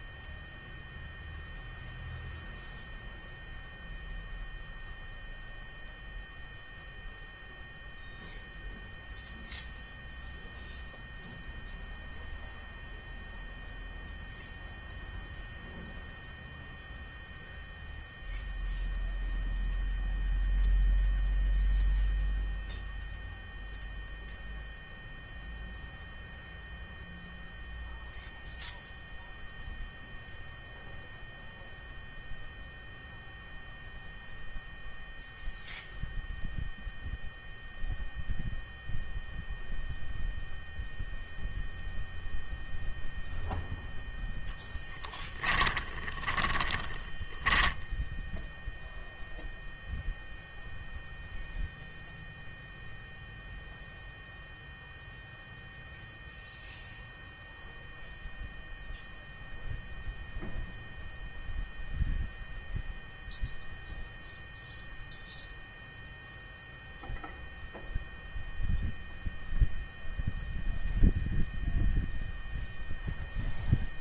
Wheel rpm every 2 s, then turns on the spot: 0, 0, 0, 0, 0, 0, 0, 0, 0, 0, 0, 0, 0, 0, 0, 0, 0, 0, 0, 0, 0, 0, 10, 10, 0, 0, 0, 0, 0, 0, 0, 0, 0, 0, 0, 0, 0.
44-48